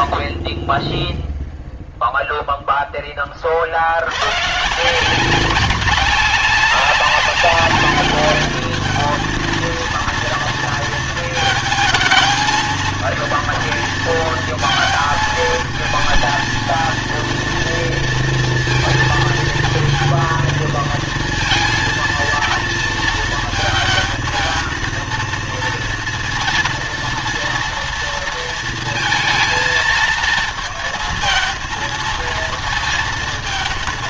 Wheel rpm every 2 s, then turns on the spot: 0, 10, 150, 200, 210, 230, 230, 220, 230, 230, 230, 230, 230, 230, 230, 220, 230.
none